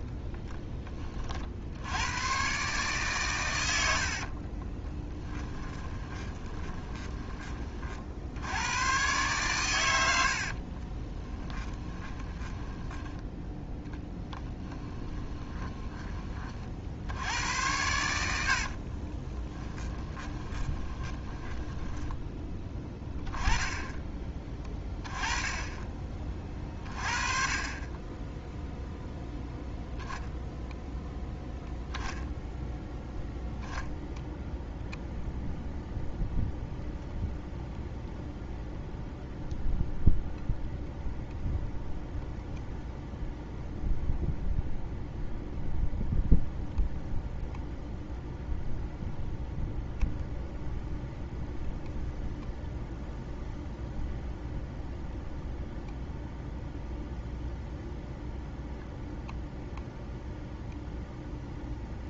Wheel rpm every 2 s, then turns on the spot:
30, 130, 20, 20, 110, 40, 10, 10, 60, 50, 20, 10, 10, 30, 0, 0, 0, 0, 0, 0, 0, 0, 0, 0, 0, 0, 0, 0, 0, 0, 0.
4-8 10-16 18-22